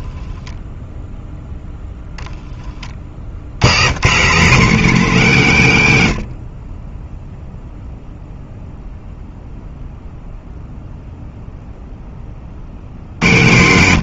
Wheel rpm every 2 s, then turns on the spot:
0, 40, 210, 20, 0, 0, 70.
none